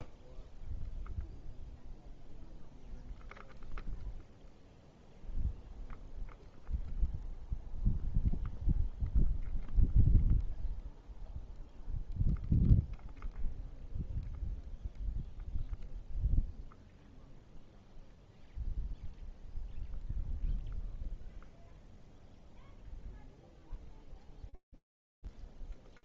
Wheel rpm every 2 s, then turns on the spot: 0, 0, 0, 0, 0, 0, 0, 0, 0, 0, 0, 0, 0.
none